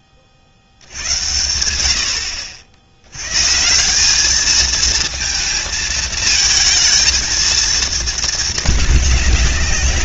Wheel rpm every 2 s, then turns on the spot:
70, 90, 220, 230, 210.
none